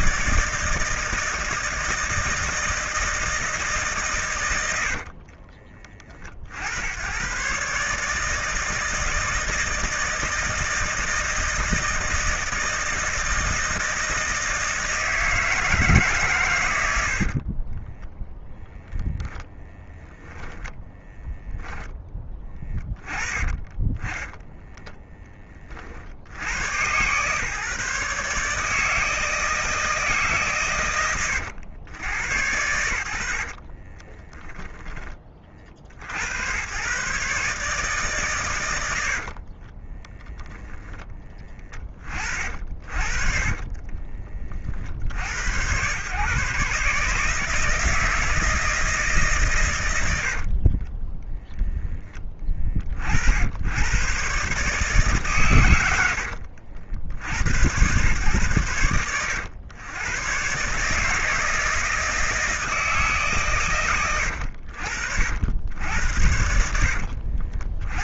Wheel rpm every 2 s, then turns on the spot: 160, 160, 90, 60, 160, 160, 160, 160, 110, 10, 10, 20, 20, 90, 150, 130, 80, 10, 110, 120, 10, 40, 50, 140, 160, 50, 30, 140, 70, 110, 130, 160, 70, 80.
4-6 16-18 20-22 24-26 34-36 50-52 66-68